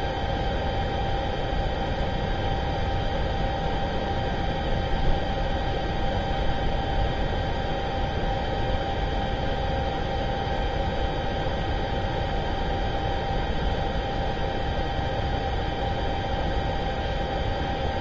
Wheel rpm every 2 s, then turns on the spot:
0, 0, 0, 0, 0, 0, 0, 0, 0.
none